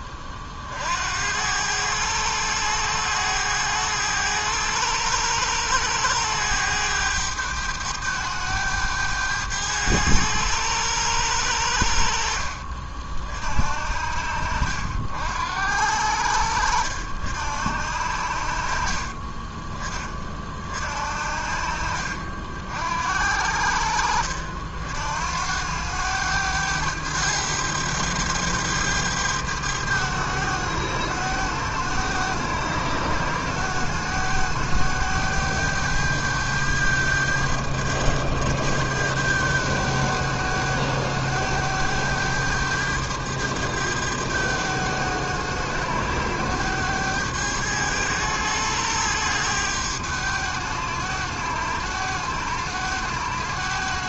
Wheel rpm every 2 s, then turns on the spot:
40, 100, 100, 100, 100, 100, 50, 70, 70, 60, 40, 60, 60, 100, 100, 100, 100, 100, 100, 100, 100, 100, 100, 100, 100, 100, 100.
14-16